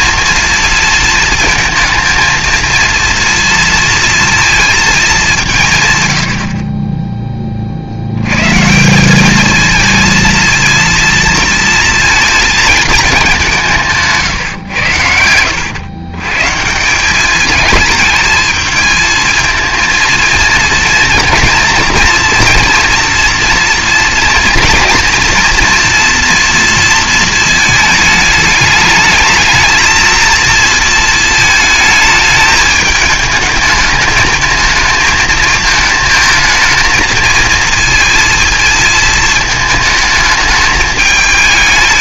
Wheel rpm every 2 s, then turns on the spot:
220, 230, 230, 50, 140, 230, 220, 120, 140, 220, 230, 230, 240, 230, 210, 230, 220, 220, 220, 230, 220.
none